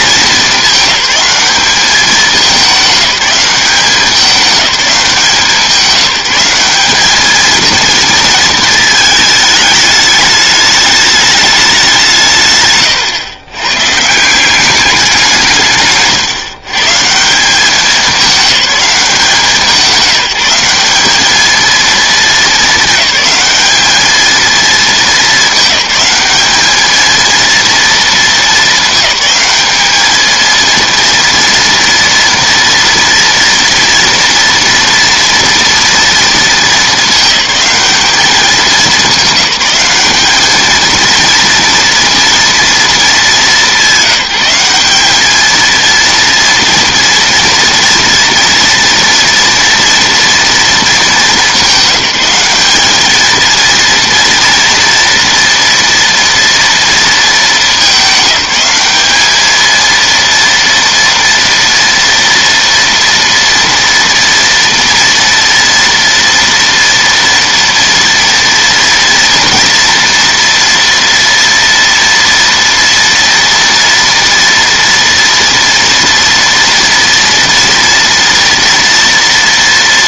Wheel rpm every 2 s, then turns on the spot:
210, 200, 190, 210, 220, 210, 120, 190, 160, 180, 200, 210, 210, 220, 210, 230, 230, 230, 210, 200, 230, 220, 210, 230, 230, 210, 220, 230, 230, 200, 230, 230, 230, 230, 230, 230, 230, 230, 230, 230.
none